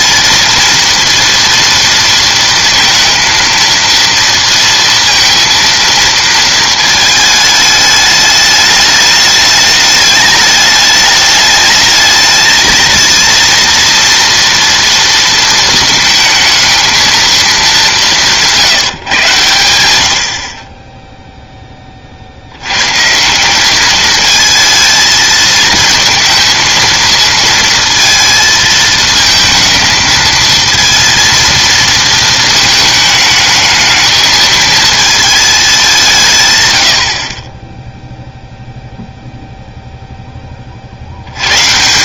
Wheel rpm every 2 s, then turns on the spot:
230, 230, 230, 220, 210, 210, 220, 230, 220, 170, 30, 100, 220, 230, 220, 220, 220, 220, 130, 0, 30.
none